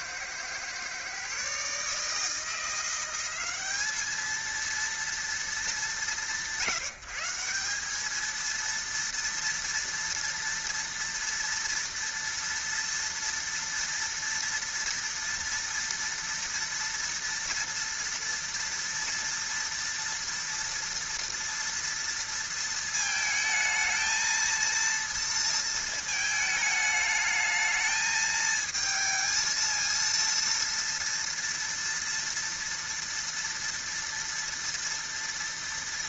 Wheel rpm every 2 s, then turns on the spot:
120, 160, 220, 150, 220, 230, 230, 230, 230, 230, 230, 230, 230, 220, 220, 230, 230, 230.
none